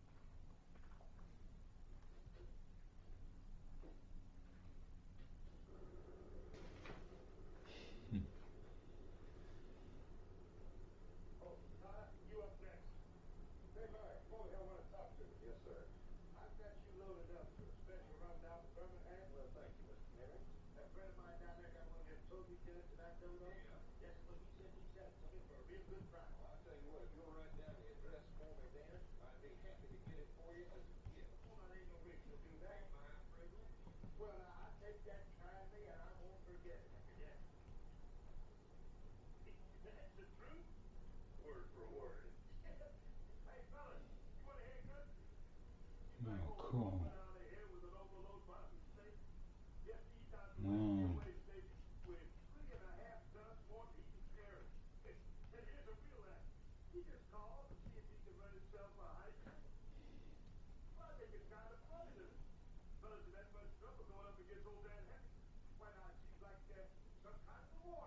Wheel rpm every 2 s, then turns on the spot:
0, 0, 0, 0, 0, 0, 0, 0, 0, 0, 0, 0, 0, 0, 0, 0, 0, 0, 0, 0, 0, 0, 0, 0, 0, 0, 0, 0, 0, 0, 0, 0, 0, 0.
none